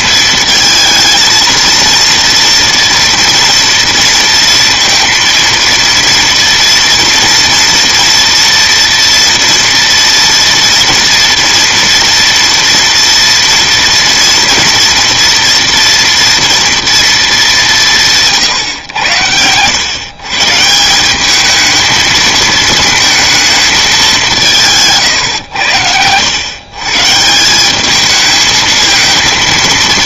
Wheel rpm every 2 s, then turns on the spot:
220, 230, 230, 230, 230, 230, 230, 230, 230, 120, 180, 220, 140, 140, 220.
none